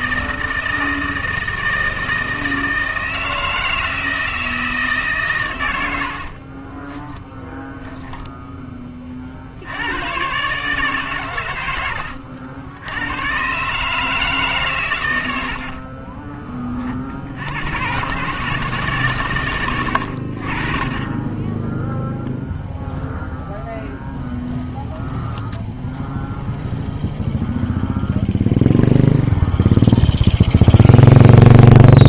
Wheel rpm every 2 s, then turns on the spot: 160, 160, 160, 30, 20, 140, 80, 130, 30, 150, 40, 0, 0, 0, 0, 0.
6-8